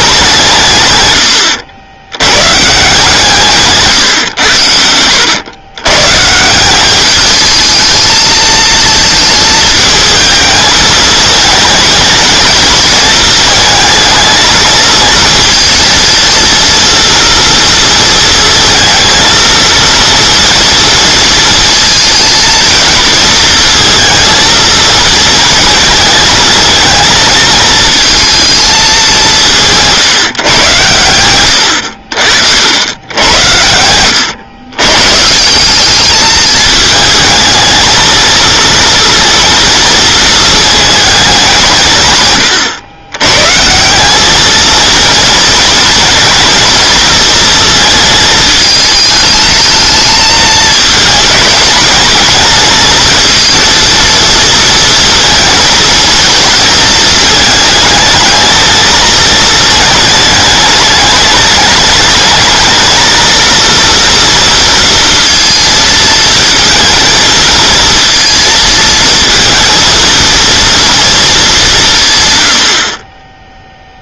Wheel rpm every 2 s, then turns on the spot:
150, 130, 100, 170, 230, 220, 220, 220, 230, 220, 230, 230, 220, 220, 220, 120, 80, 110, 220, 230, 220, 100, 220, 230, 220, 220, 220, 230, 220, 220, 210, 220, 230, 230, 230, 230, 90.
none